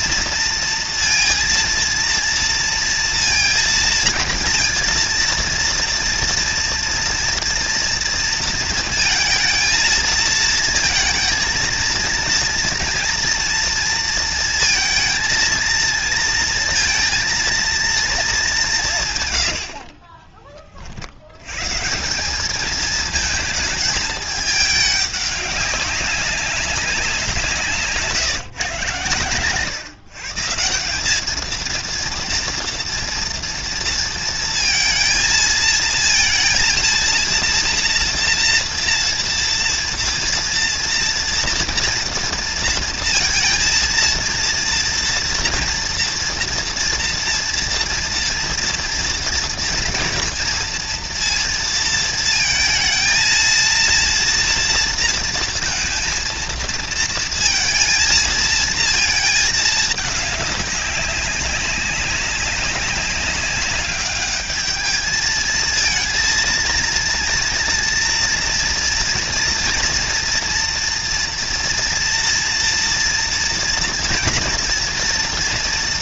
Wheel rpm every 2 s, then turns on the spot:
230, 230, 230, 240, 230, 220, 230, 220, 230, 150, 50, 220, 210, 190, 120, 180, 230, 230, 230, 230, 230, 230, 230, 230, 230, 230, 230, 230, 230, 220, 200, 190, 210, 230, 230, 230, 230, 230.
none